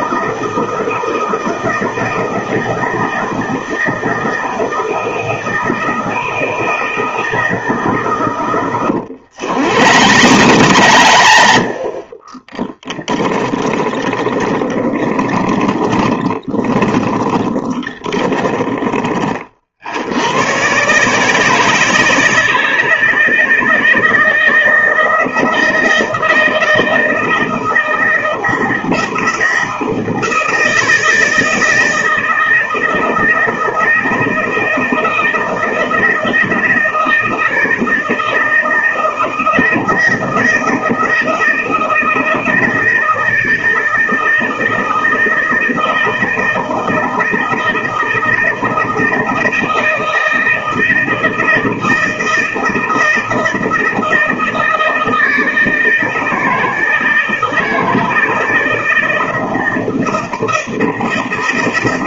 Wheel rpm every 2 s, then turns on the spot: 160, 160, 160, 160, 110, 110, 20, 20, 30, 20, 120, 160, 160, 160, 160, 160, 160, 160, 160, 160, 160, 160, 160, 160, 160, 160, 160, 160, 160, 170, 160.
8-20